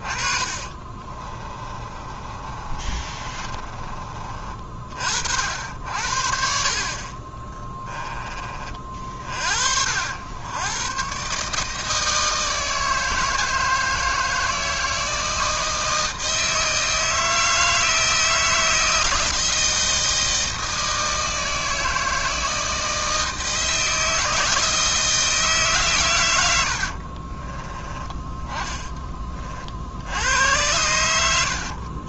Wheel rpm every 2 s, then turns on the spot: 30, 30, 40, 40, 40, 120, 160, 160, 160, 160, 160, 160, 160, 70, 20, 100.
0-4 26-30